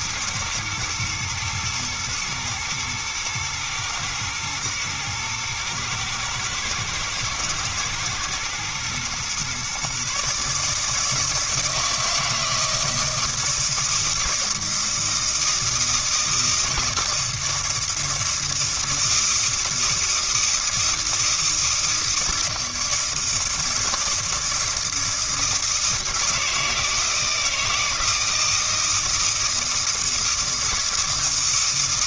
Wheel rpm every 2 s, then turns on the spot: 120, 110, 110, 110, 120, 150, 160, 160, 160, 160, 160, 160, 160, 160, 160, 160.
none